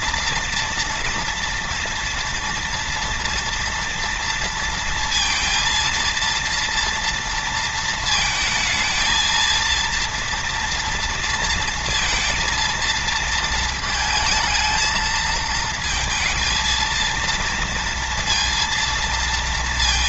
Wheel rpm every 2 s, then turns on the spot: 230, 230, 230, 230, 220, 230, 230, 220, 220, 230.
none